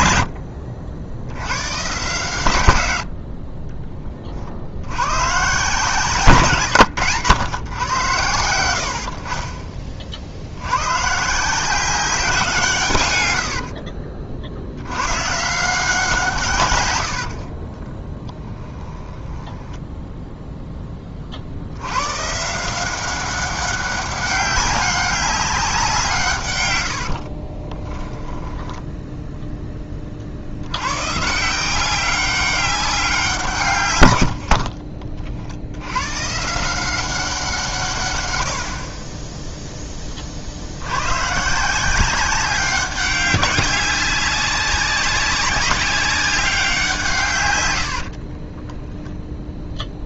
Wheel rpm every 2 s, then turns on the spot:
60, 120, 80, 130, 90, 90, 150, 70, 120, 10, 10, 170, 200, 110, 10, 80, 190, 60, 160, 100, 60, 190, 190, 190, 10.
18-20 28-30 34-36 48-50